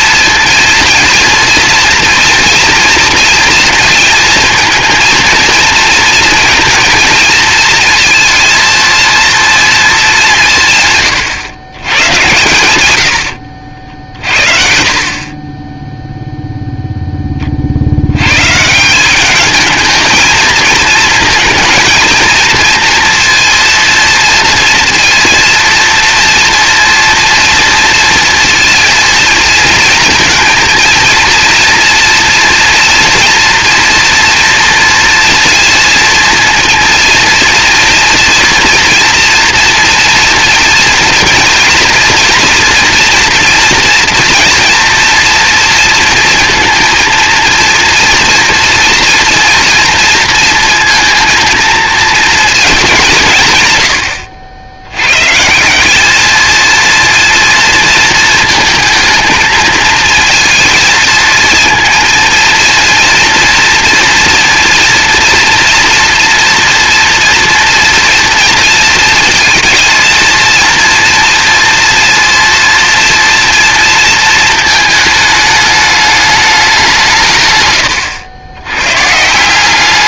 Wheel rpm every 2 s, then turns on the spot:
230, 240, 230, 230, 230, 150, 100, 50, 0, 160, 220, 230, 240, 230, 230, 230, 230, 230, 230, 240, 230, 230, 230, 230, 230, 230, 210, 90, 230, 220, 230, 230, 230, 240, 230, 230, 230, 220, 190, 120.
14-16